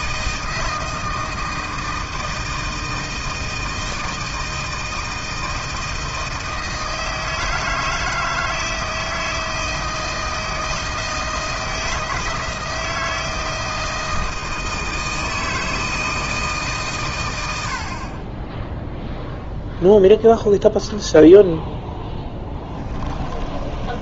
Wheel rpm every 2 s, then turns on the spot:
160, 160, 160, 160, 160, 160, 160, 160, 140, 0, 0, 20.
22-24